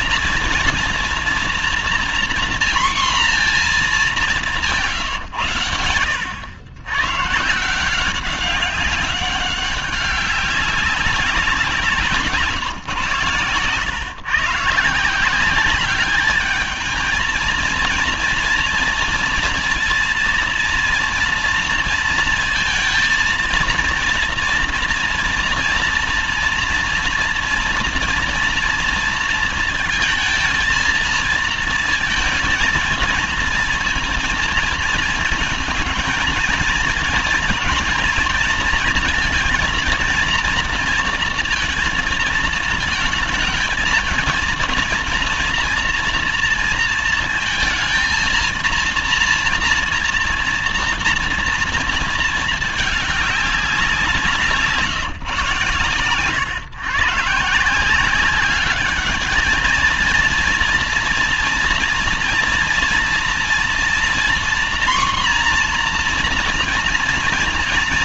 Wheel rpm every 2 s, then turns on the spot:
230, 240, 190, 110, 190, 190, 140, 160, 220, 230, 230, 230, 230, 230, 230, 230, 230, 220, 220, 230, 230, 220, 230, 230, 230, 230, 210, 160, 130, 200, 230, 230, 240, 230.
none